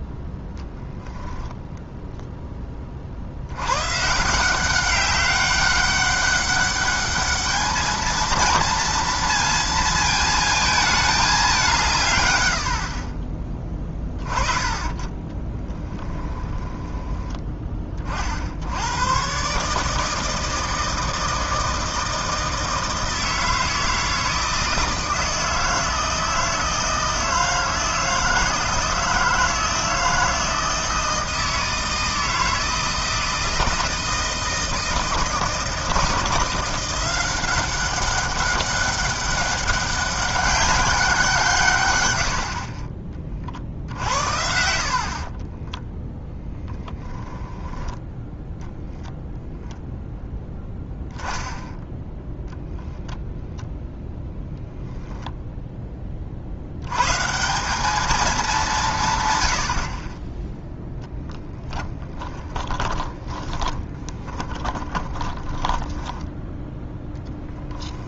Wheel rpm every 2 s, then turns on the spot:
10, 30, 190, 200, 230, 220, 100, 20, 10, 100, 160, 160, 160, 160, 160, 160, 160, 160, 180, 200, 200, 40, 60, 0, 0, 0, 0, 0, 100, 160, 0, 20, 20, 10.
62-66